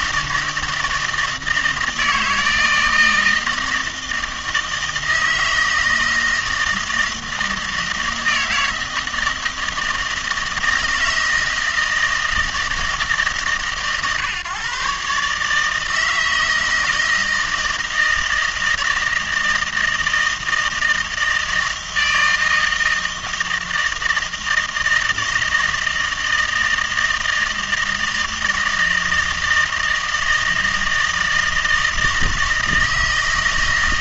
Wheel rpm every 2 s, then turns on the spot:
160, 160, 160, 160, 160, 160, 160, 130, 160, 160, 160, 160, 160, 160, 160, 160, 160.
none